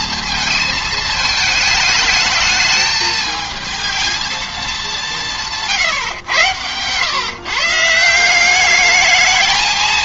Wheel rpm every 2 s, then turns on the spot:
220, 210, 210, 110, 200.
none